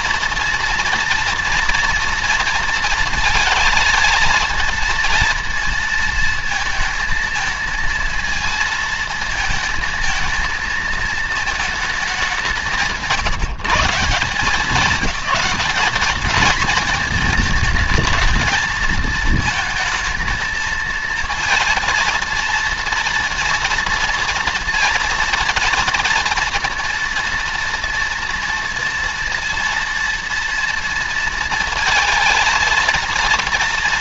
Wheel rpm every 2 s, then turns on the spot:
230, 230, 220, 220, 230, 220, 170, 190, 220, 220, 230, 230, 230, 230, 230, 230, 230.
none